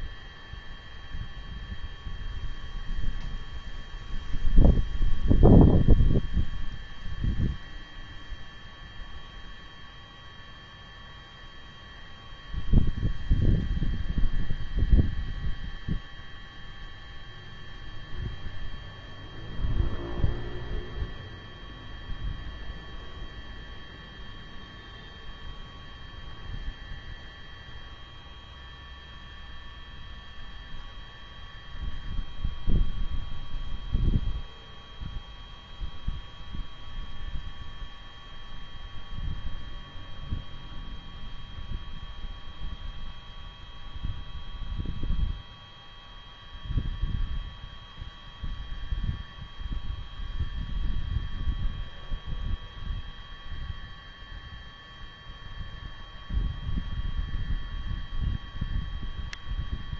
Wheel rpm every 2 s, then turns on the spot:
0, 0, 0, 0, 0, 0, 0, 0, 0, 0, 0, 0, 0, 0, 0, 0, 0, 0, 0, 0, 0, 0, 0, 0, 0, 0, 0, 0, 0, 0.
none